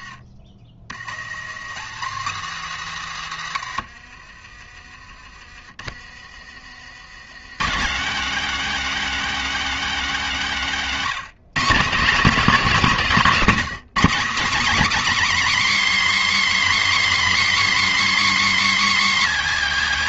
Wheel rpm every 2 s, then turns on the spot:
70, 140, 30, 130, 270, 210, 220, 310, 310, 300.
none